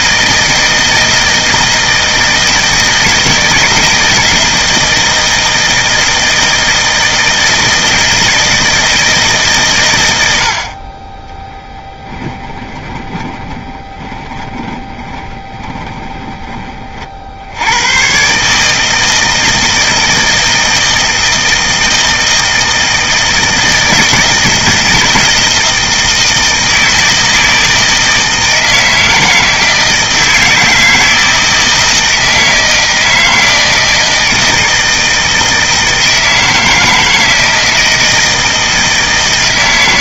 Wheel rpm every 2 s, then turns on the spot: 160, 160, 160, 160, 160, 30, 10, 10, 40, 160, 160, 160, 160, 160, 160, 160, 160, 160, 160, 160.
12-16